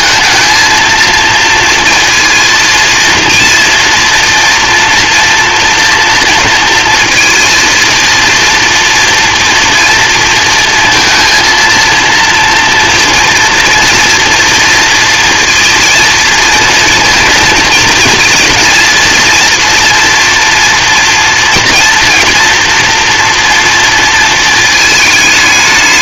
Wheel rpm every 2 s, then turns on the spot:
230, 230, 230, 230, 230, 230, 230, 240, 230, 230, 240, 230, 220.
none